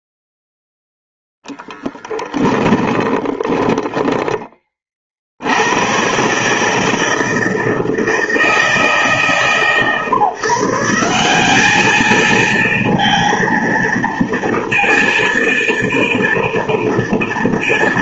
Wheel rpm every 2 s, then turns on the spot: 0, 10, 20, 140, 160, 150, 230, 230, 230.
2-4